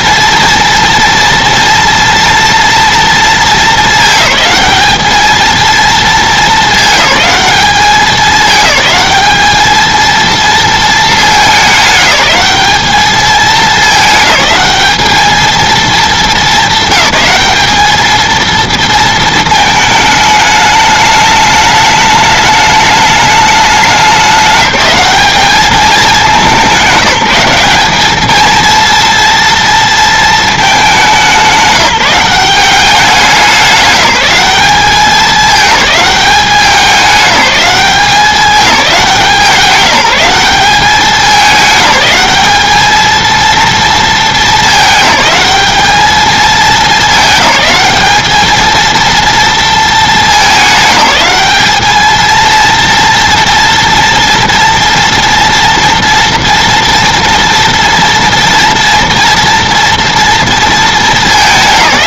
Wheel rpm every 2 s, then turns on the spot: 230, 230, 210, 220, 210, 230, 210, 210, 220, 230, 210, 210, 200, 200, 220, 220, 190, 200, 200, 190, 200, 220, 220, 220, 220, 210, 230, 230, 230, 230, 230.
none